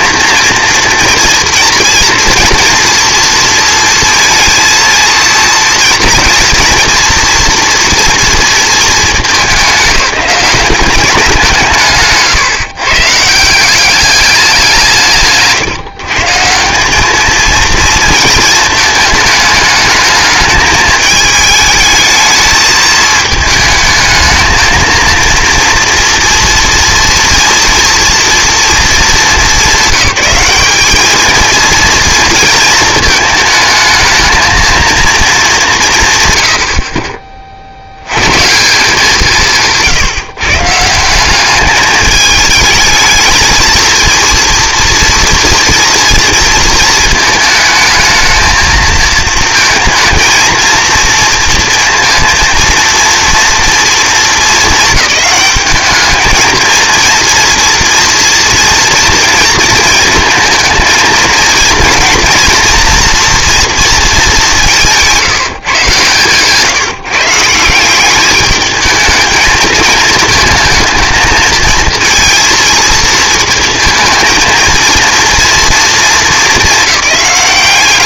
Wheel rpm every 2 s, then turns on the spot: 230, 230, 230, 230, 220, 190, 150, 180, 180, 220, 220, 220, 220, 230, 220, 200, 230, 230, 50, 160, 160, 210, 230, 230, 220, 230, 230, 220, 220, 240, 220, 240, 200, 150, 220, 220, 230, 220, 210.
none